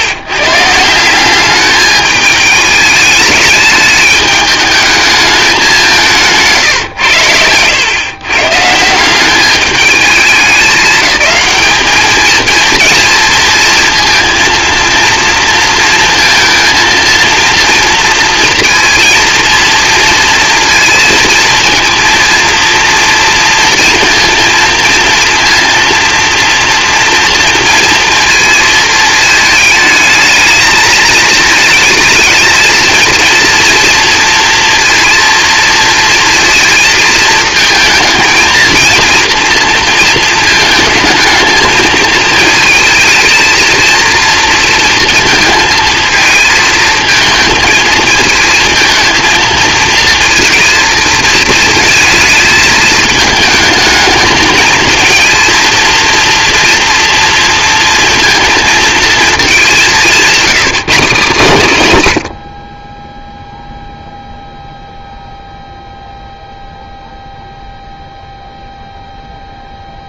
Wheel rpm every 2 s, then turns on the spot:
150, 210, 210, 150, 150, 210, 220, 230, 230, 230, 230, 230, 230, 230, 230, 220, 220, 230, 230, 230, 220, 220, 230, 220, 220, 230, 220, 220, 240, 230, 180, 40, 0, 0, 0.
none